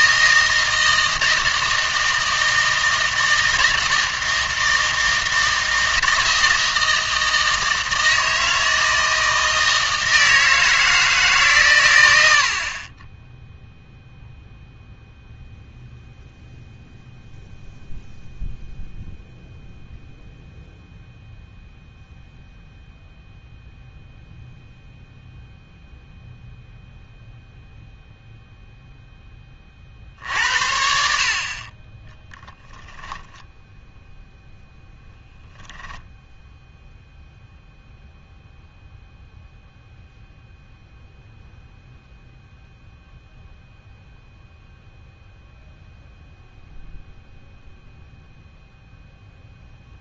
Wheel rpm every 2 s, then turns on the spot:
160, 160, 160, 160, 160, 160, 40, 0, 0, 0, 0, 0, 0, 0, 0, 70, 20, 0, 0, 0, 0, 0, 0, 0, 0.
32-34